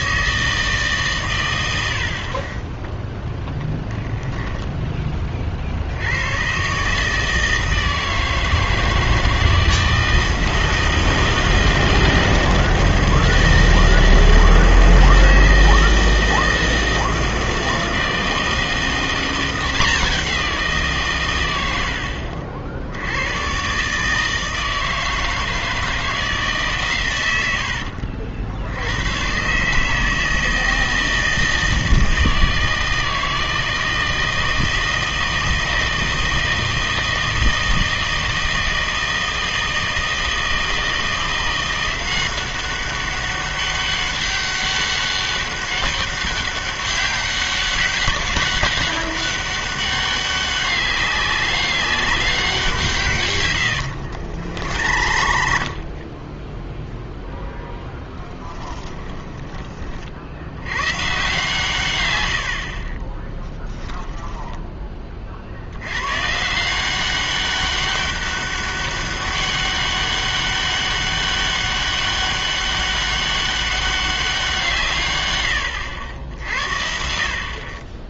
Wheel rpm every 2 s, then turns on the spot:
160, 20, 10, 130, 160, 160, 160, 160, 160, 170, 170, 70, 160, 140, 70, 160, 160, 160, 160, 160, 170, 190, 200, 200, 200, 200, 170, 80, 10, 10, 100, 60, 10, 180, 200, 200, 200, 170, 60.
4-6 54-56 58-60